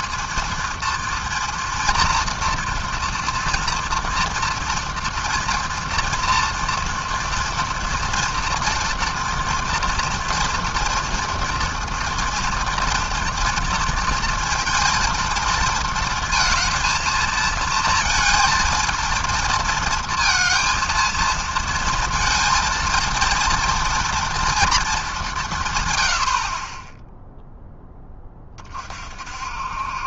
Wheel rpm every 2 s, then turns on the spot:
230, 230, 230, 230, 230, 230, 230, 230, 230, 230, 230, 230, 230, 60, 30.
none